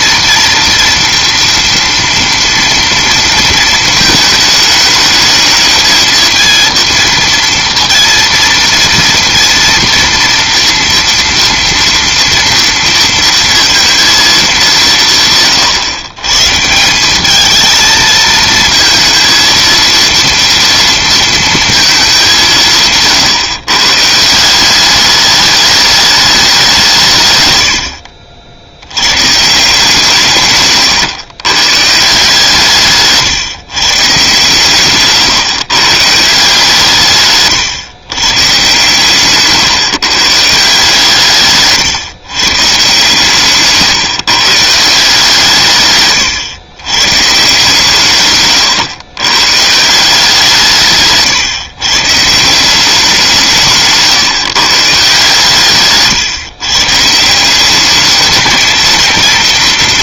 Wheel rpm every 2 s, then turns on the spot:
230, 230, 220, 230, 230, 230, 230, 190, 160, 220, 230, 170, 190, 190, 70, 130, 160, 140, 160, 140, 160, 140, 150, 120, 120, 160, 170, 140, 140, 230.
none